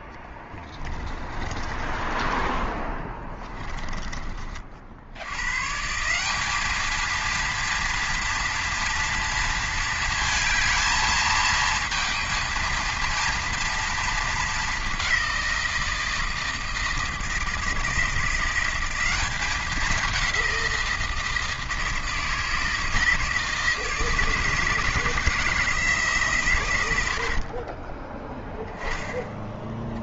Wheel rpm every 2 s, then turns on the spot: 20, 20, 40, 210, 240, 230, 230, 210, 160, 180, 180, 160, 160, 120, 10.
0-2